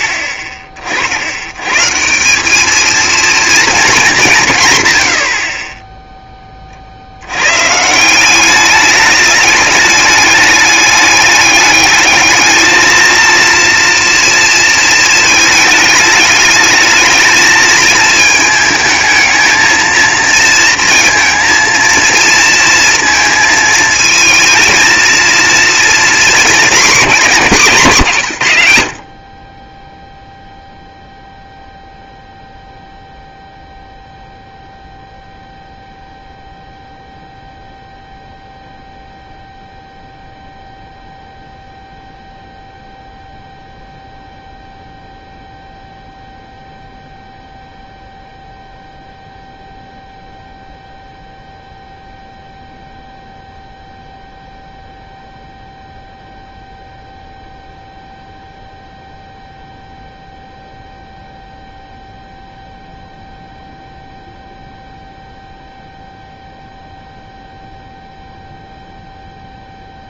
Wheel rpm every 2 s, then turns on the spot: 30, 220, 100, 50, 210, 210, 230, 230, 220, 220, 230, 220, 230, 220, 110, 0, 0, 0, 0, 0, 0, 0, 0, 0, 0, 0, 0, 0, 0, 0, 0, 0, 0, 0, 0.
none